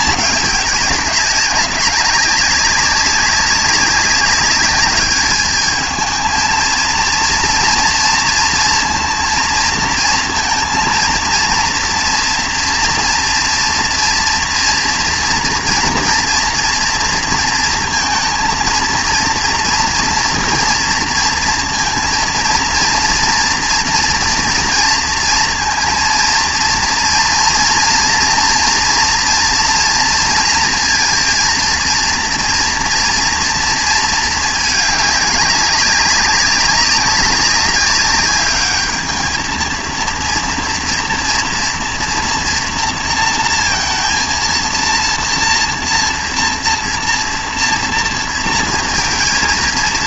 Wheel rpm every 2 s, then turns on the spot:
200, 200, 200, 220, 230, 230, 230, 230, 230, 230, 230, 230, 230, 230, 230, 230, 240, 220, 200, 210, 230, 230, 230, 230, 230.
none